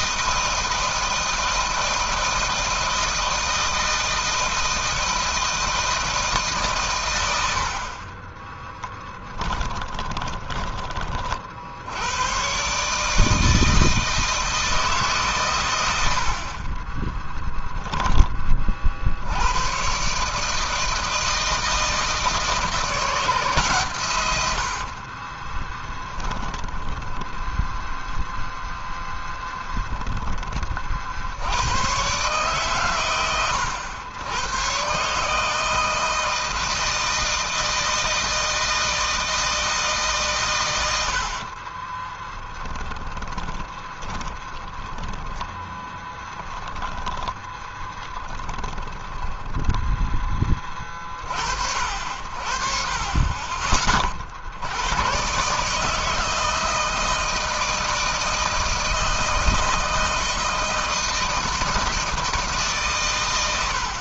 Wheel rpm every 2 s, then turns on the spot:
160, 160, 160, 150, 20, 20, 120, 160, 50, 30, 150, 160, 90, 20, 0, 30, 130, 110, 160, 160, 120, 10, 20, 10, 30, 20, 50, 70, 160, 160, 160, 150.
8-10 16-18 24-28 42-46 48-50